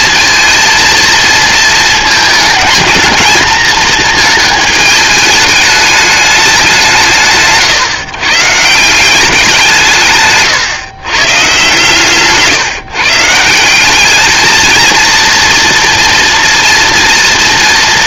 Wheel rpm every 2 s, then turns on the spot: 230, 220, 220, 200, 150, 140, 140, 220, 230.
none